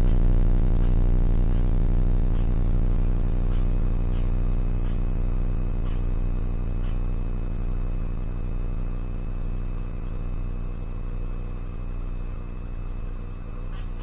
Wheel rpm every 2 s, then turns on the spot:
0, 0, 0, 0, 0, 0, 0.
none